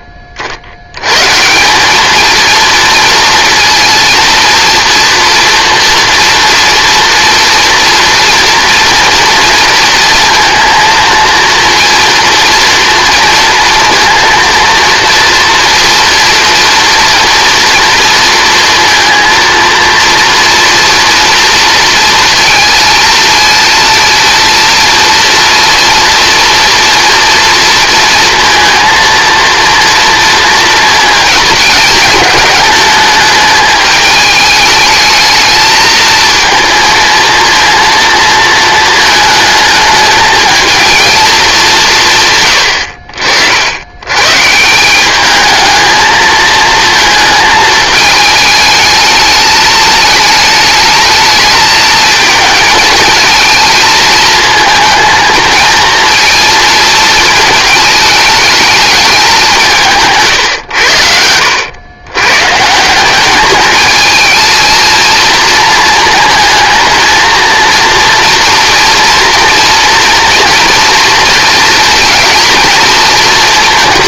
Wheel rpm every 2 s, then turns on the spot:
60, 230, 230, 230, 230, 230, 230, 230, 230, 230, 230, 230, 230, 230, 230, 220, 210, 210, 230, 230, 220, 110, 160, 220, 210, 220, 220, 220, 230, 220, 120, 150, 220, 220, 230, 240, 230.
none